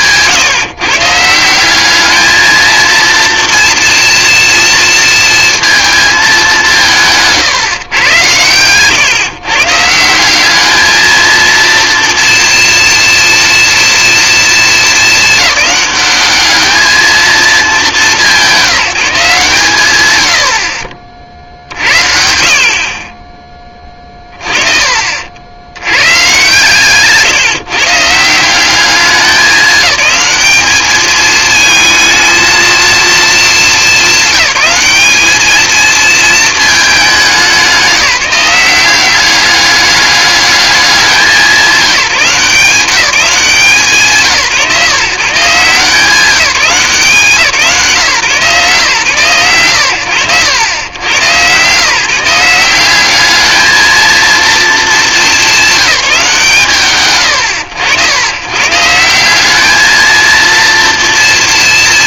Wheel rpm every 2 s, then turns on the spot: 150, 230, 230, 160, 130, 220, 230, 220, 210, 180, 60, 30, 50, 150, 200, 220, 220, 210, 200, 190, 190, 190, 150, 170, 120, 110, 200, 210, 80, 180, 230.
none